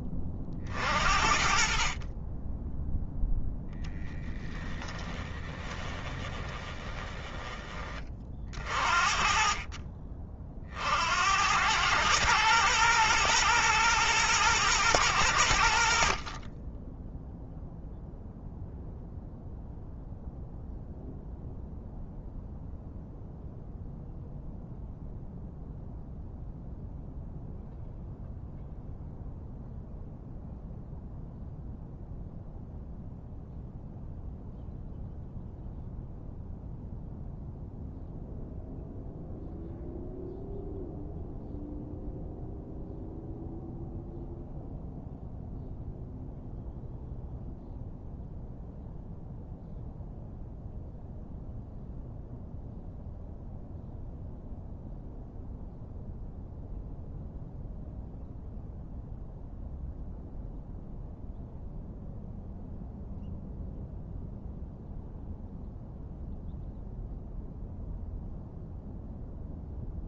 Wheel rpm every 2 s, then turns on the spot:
50, 10, 20, 20, 50, 70, 120, 110, 10, 0, 0, 0, 0, 0, 0, 0, 0, 0, 0, 0, 0, 0, 0, 0, 0, 0, 0, 0, 0, 0, 0, 0, 0, 0, 0.
4-8